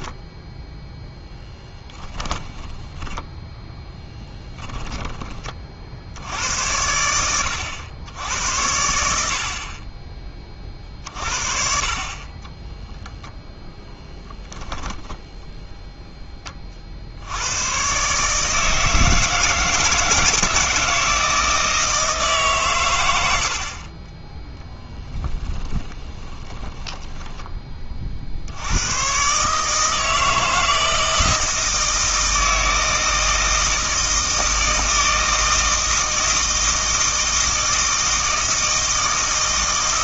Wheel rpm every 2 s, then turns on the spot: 0, 10, 10, 90, 80, 40, 10, 10, 50, 160, 160, 110, 10, 10, 100, 160, 160, 160, 160, 160.
2-6 12-16 26-28